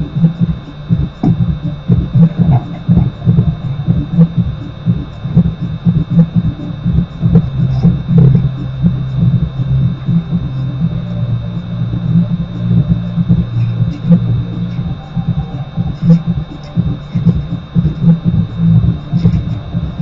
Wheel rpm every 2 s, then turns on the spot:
0, 0, 0, 0, 0, 0, 0, 0, 0, 0.
none